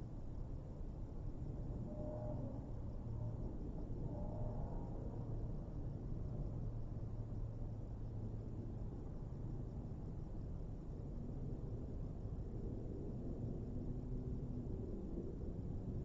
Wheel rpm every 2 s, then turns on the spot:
0, 0, 0, 0, 0, 0, 0, 0.
none